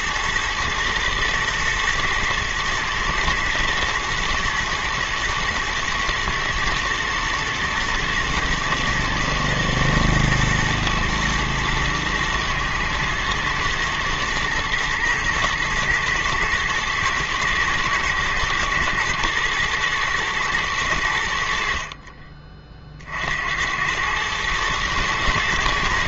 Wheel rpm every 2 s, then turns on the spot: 120, 120, 120, 110, 120, 110, 110, 120, 110, 120, 110, 30, 110.
none